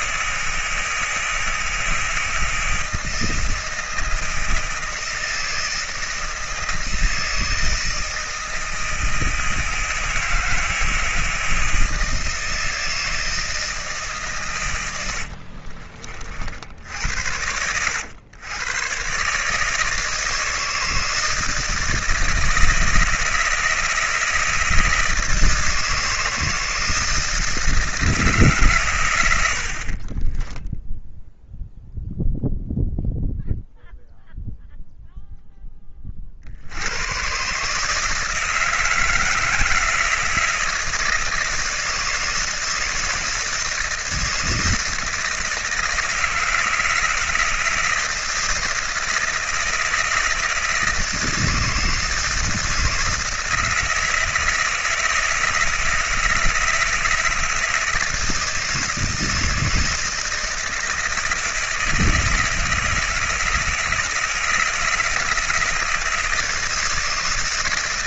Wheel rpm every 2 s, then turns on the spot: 160, 160, 160, 160, 160, 160, 160, 90, 70, 120, 160, 160, 160, 160, 120, 0, 0, 0, 90, 160, 160, 160, 160, 160, 160, 160, 160, 160, 160, 160, 160, 160, 160, 160.
none